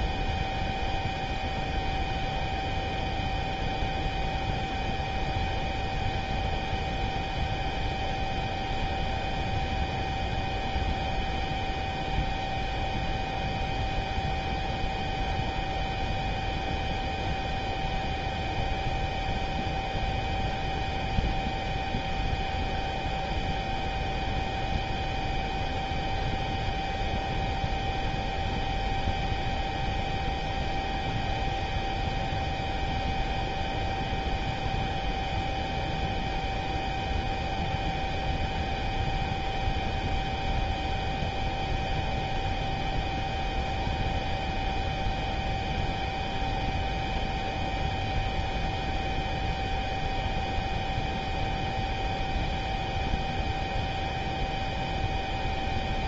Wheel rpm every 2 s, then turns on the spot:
0, 0, 0, 0, 0, 0, 0, 0, 0, 0, 0, 0, 0, 0, 0, 0, 0, 0, 0, 0, 0, 0, 0, 0, 0, 0, 0, 0.
none